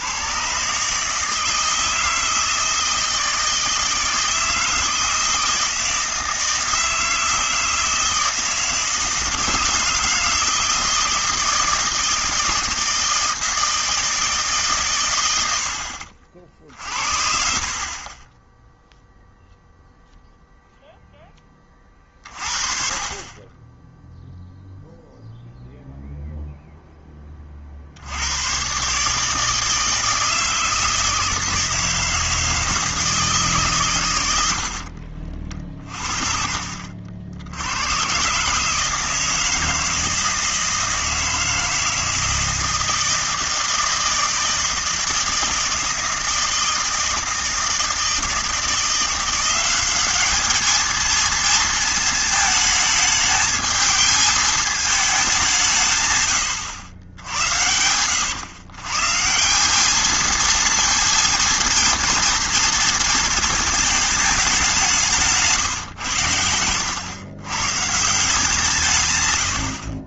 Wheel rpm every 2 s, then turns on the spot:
140, 160, 160, 160, 160, 160, 160, 120, 50, 0, 0, 40, 0, 0, 110, 160, 160, 80, 50, 140, 160, 160, 160, 160, 160, 210, 220, 220, 110, 120, 230, 230, 190, 90, 160.
34-36